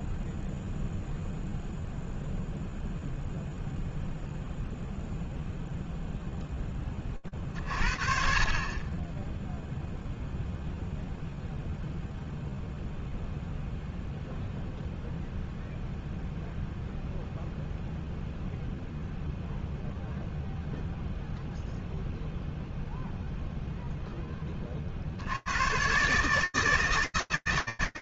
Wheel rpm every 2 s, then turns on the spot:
0, 0, 0, 20, 30, 0, 0, 0, 0, 0, 0, 0, 120, 160.
none